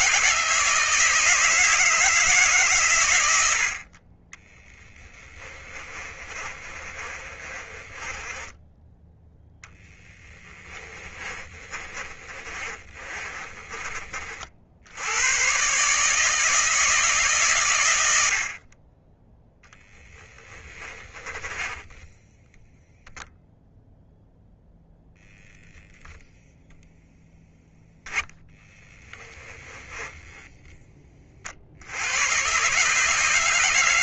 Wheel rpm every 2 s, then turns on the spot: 160, 130, 10, 30, 10, 20, 30, 70, 160, 30, 20, 0, 0, 0, 10, 10, 150.
4-14 20-22 28-30